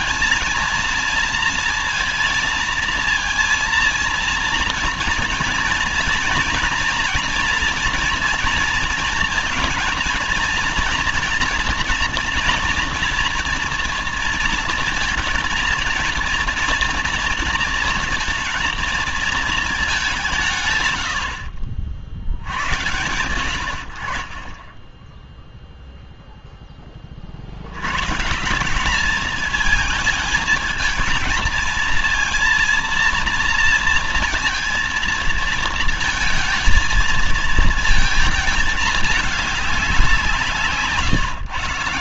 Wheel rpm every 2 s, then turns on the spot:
220, 230, 230, 230, 230, 230, 230, 230, 230, 230, 170, 70, 20, 0, 160, 220, 230, 230, 230, 220, 170.
none